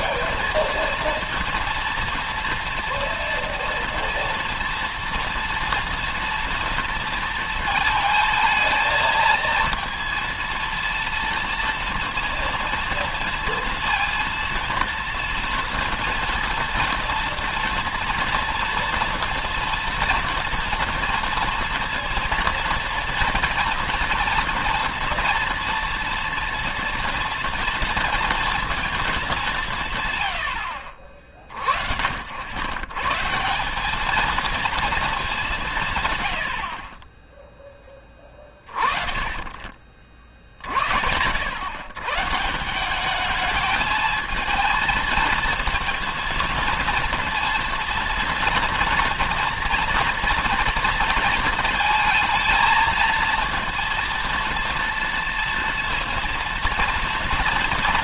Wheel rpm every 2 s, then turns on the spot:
220, 230, 230, 230, 220, 230, 230, 230, 230, 240, 230, 230, 230, 230, 230, 80, 100, 220, 70, 30, 50, 170, 220, 230, 230, 230, 220, 230, 230.
none